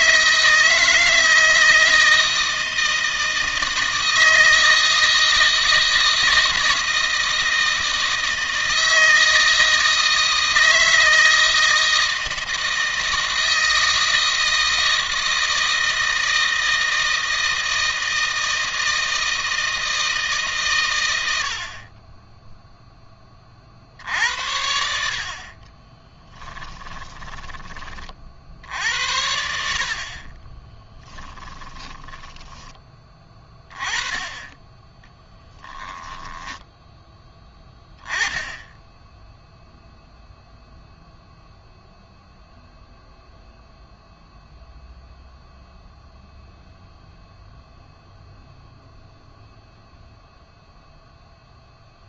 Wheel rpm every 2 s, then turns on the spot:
160, 160, 160, 160, 160, 160, 160, 160, 160, 160, 150, 10, 80, 20, 60, 30, 20, 10, 10, 10, 0, 0, 0, 0, 0, 0.
26-28 30-32